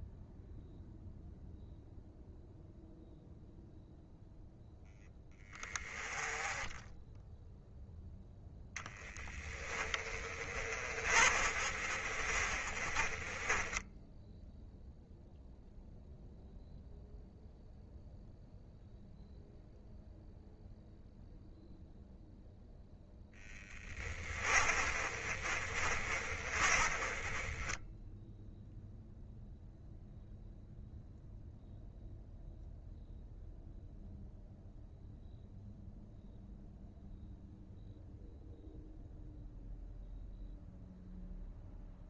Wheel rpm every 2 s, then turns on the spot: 0, 0, 0, 10, 10, 30, 30, 0, 0, 0, 0, 0, 30, 20, 0, 0, 0, 0, 0, 0, 0.
8-14 24-28